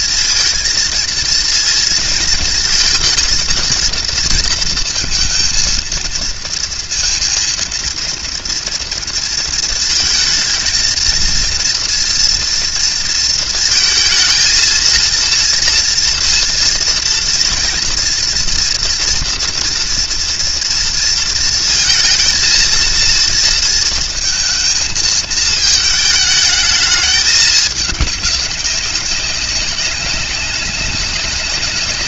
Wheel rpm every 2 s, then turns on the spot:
230, 230, 230, 230, 230, 230, 230, 230, 230, 230, 230, 230, 230, 220, 200, 190.
none